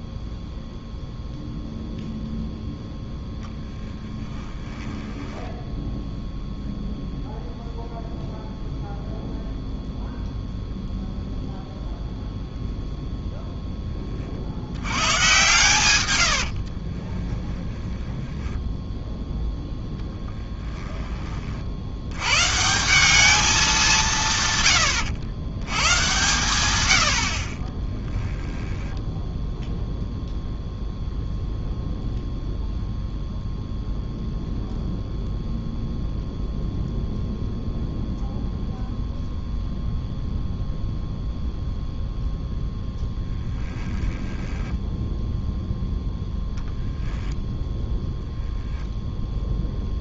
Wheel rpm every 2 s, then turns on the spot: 0, 0, 20, 0, 0, 0, 0, 70, 60, 10, 10, 150, 130, 110, 10, 0, 0, 0, 0, 0, 0, 10, 10, 0, 0.
4-6 16-18 28-30 42-46